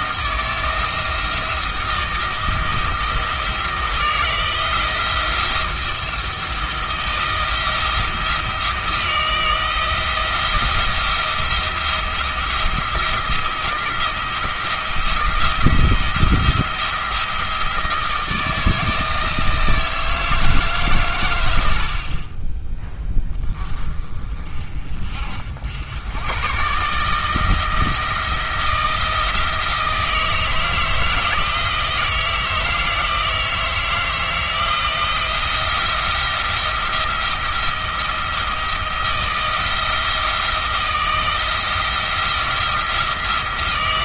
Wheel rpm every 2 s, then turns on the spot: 170, 170, 170, 170, 160, 170, 170, 170, 170, 160, 140, 20, 40, 140, 160, 160, 160, 170, 170, 160, 170, 170.
none